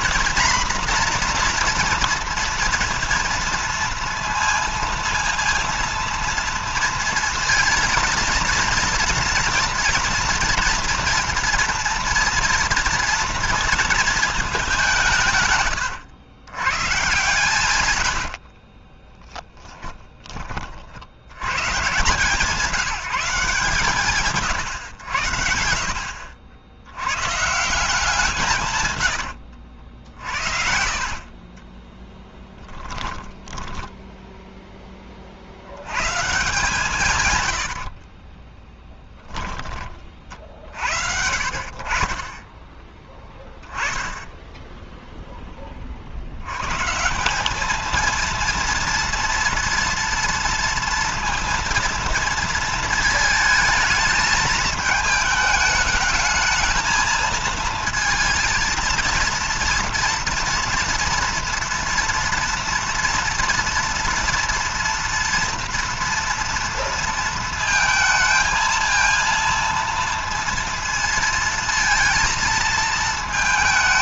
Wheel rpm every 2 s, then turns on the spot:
240, 230, 230, 230, 230, 230, 230, 160, 130, 20, 70, 170, 100, 110, 110, 50, 10, 30, 130, 20, 70, 10, 10, 170, 230, 230, 220, 220, 220, 230, 230, 230, 230, 230, 230, 230, 220.
18-20 28-34